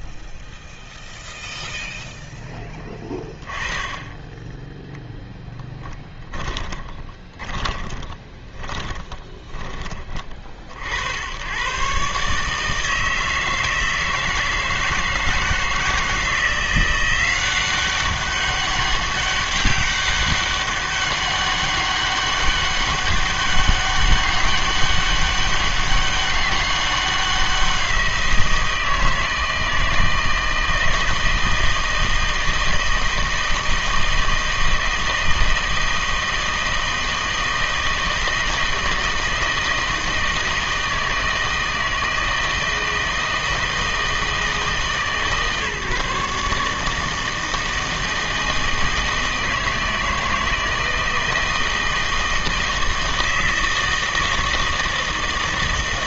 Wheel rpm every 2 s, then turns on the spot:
0, 10, 0, 20, 20, 50, 160, 160, 170, 200, 200, 200, 200, 200, 170, 160, 160, 160, 160, 160, 160, 160, 160, 150, 160, 160, 160, 160.
6-10